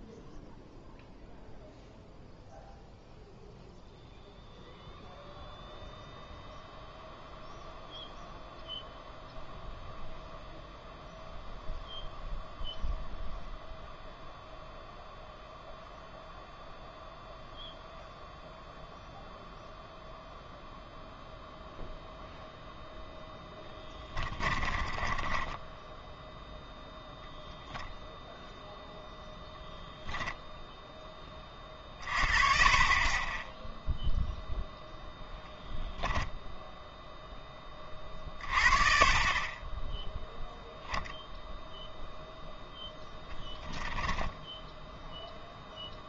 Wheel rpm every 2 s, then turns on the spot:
0, 0, 0, 0, 0, 0, 0, 0, 0, 0, 0, 0, 20, 0, 0, 0, 30, 0, 0, 30, 0, 10, 10.
24-26 42-46